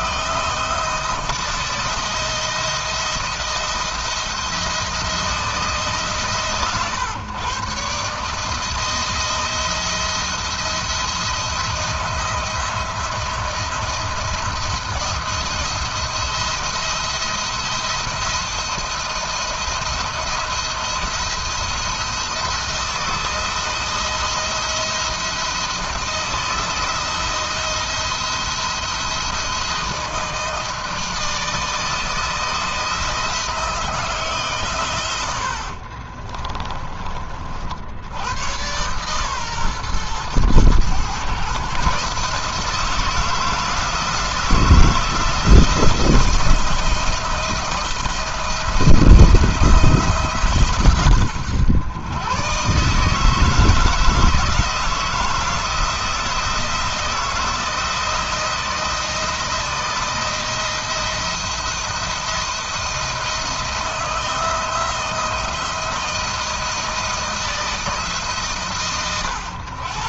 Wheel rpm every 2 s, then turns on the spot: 160, 170, 170, 120, 160, 170, 170, 170, 170, 170, 170, 160, 170, 160, 170, 160, 160, 110, 30, 120, 120, 160, 160, 160, 170, 130, 150, 160, 170, 170, 170, 170, 160, 160, 120.
none